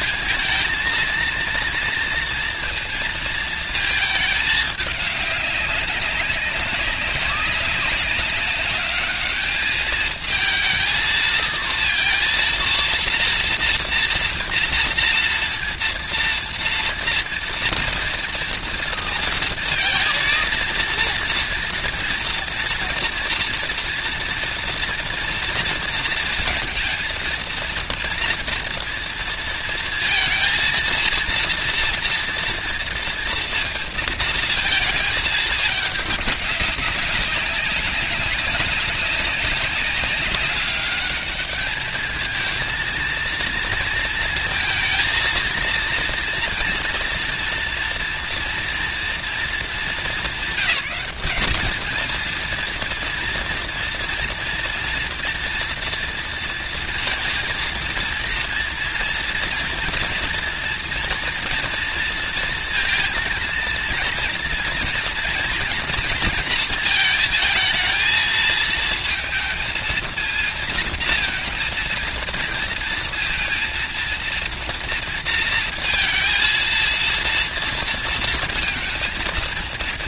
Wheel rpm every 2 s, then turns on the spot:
230, 230, 210, 200, 200, 220, 230, 230, 230, 230, 230, 230, 230, 230, 230, 230, 230, 230, 200, 190, 200, 220, 230, 240, 230, 200, 230, 230, 230, 230, 230, 230, 230, 230, 220, 220, 230, 230, 230, 230.
none